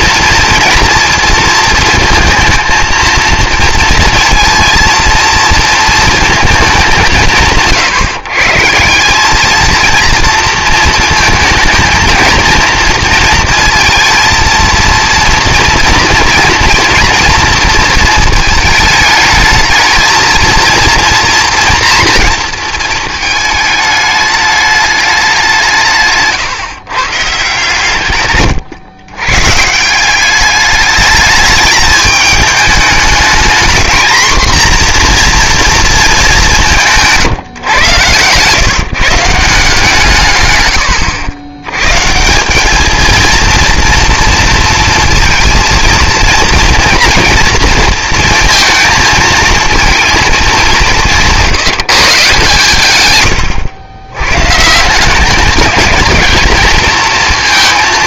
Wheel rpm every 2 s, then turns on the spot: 230, 230, 230, 170, 160, 230, 230, 230, 230, 220, 230, 230, 210, 150, 110, 200, 210, 240, 190, 140, 110, 210, 230, 230, 230, 200, 140, 160, 220.
36-38